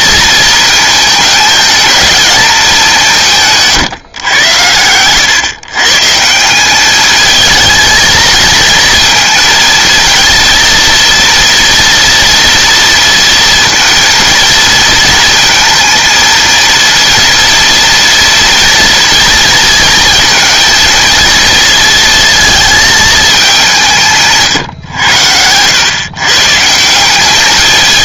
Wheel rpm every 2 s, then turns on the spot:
220, 200, 100, 190, 230, 230, 230, 230, 230, 230, 230, 220, 120, 150.
none